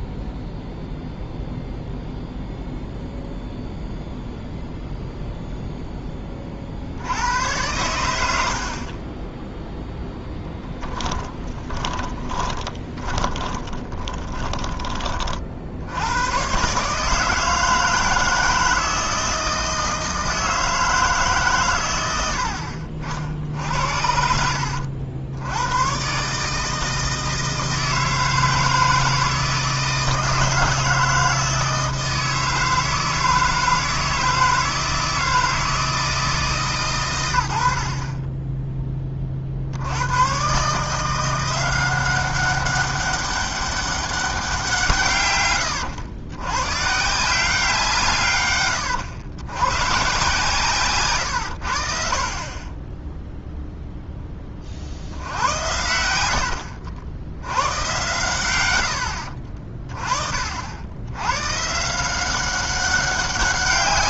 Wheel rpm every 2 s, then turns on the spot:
0, 0, 0, 60, 40, 10, 20, 20, 140, 160, 160, 50, 80, 160, 160, 160, 160, 160, 120, 20, 150, 200, 160, 140, 110, 130, 20, 40, 70, 90, 70, 190.
8-16 56-58